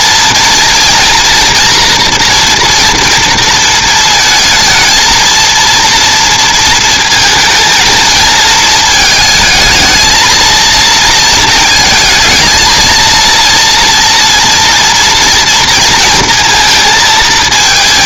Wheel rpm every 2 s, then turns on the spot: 230, 240, 220, 230, 220, 230, 230, 230, 230.
none